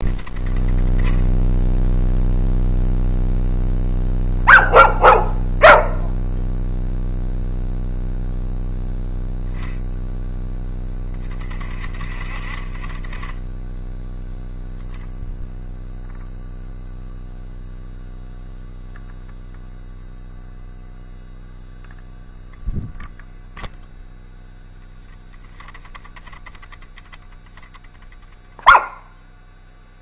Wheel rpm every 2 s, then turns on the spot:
10, 0, 0, 0, 0, 10, 20, 0, 0, 0, 0, 0, 10, 10, 0.
none